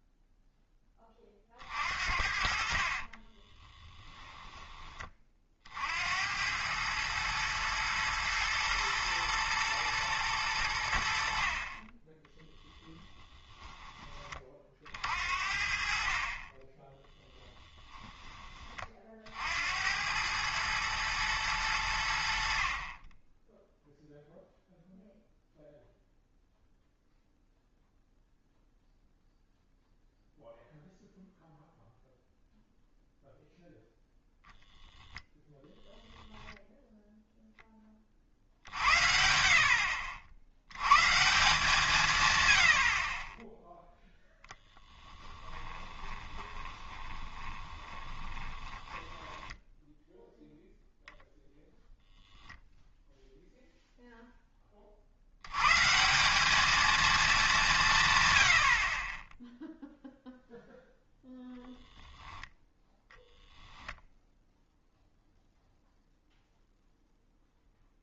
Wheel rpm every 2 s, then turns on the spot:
10, 50, 20, 110, 120, 80, 10, 50, 10, 40, 110, 30, 0, 0, 0, 0, 0, 0, 0, 70, 130, 60, 10, 20, 20, 0, 0, 40, 220, 40, 0, 0, 0, 0.
2-4 12-14 44-50